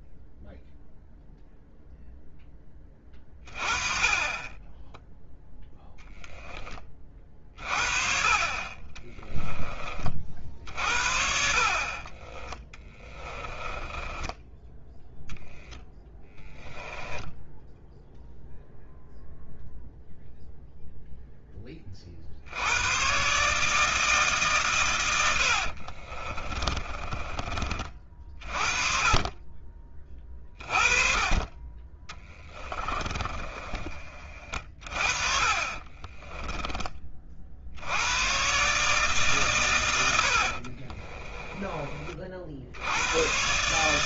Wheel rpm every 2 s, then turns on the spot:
0, 10, 20, 20, 30, 40, 10, 20, 10, 0, 0, 80, 130, 30, 40, 30, 20, 40, 20, 120, 60, 60.
12-14 16-18 26-28 32-36 40-42